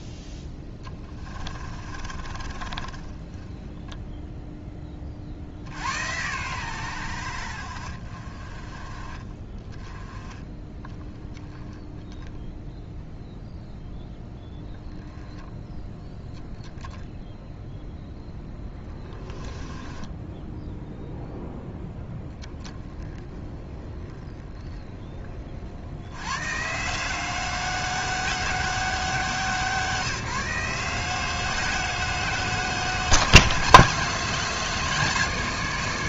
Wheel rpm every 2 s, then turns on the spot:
20, 20, 20, 90, 30, 20, 0, 10, 0, 20, 0, 20, 20, 150, 190, 160, 170, 170.
0-4 18-20